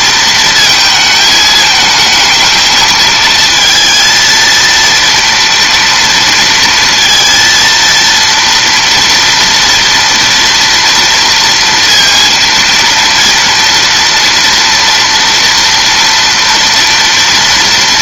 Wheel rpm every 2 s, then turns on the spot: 220, 220, 230, 230, 230, 230, 230, 230, 240.
none